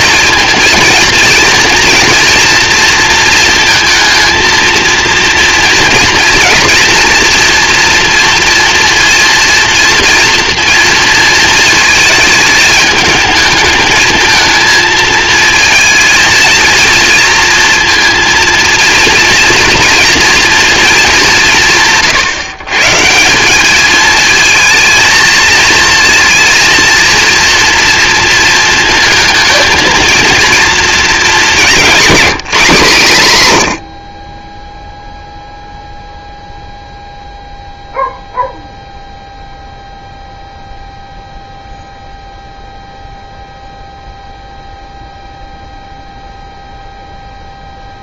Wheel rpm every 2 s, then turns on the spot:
230, 230, 230, 230, 230, 230, 220, 230, 230, 230, 230, 140, 220, 230, 230, 230, 200, 10, 0, 0, 0, 0, 0, 0.
none